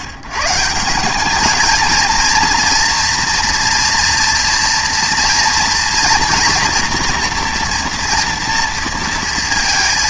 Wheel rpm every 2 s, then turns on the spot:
140, 230, 230, 230, 230.
none